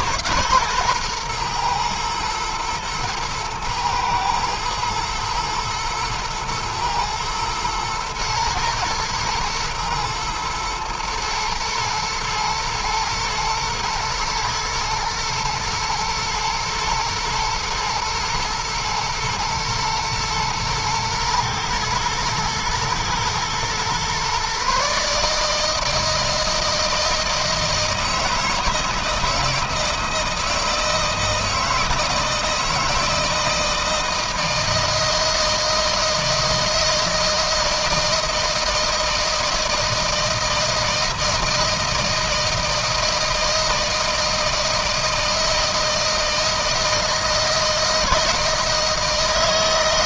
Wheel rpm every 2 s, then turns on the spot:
130, 120, 110, 120, 120, 110, 120, 120, 110, 110, 110, 110, 130, 160, 160, 160, 160, 160, 160, 160, 160, 170, 160, 170, 160.
none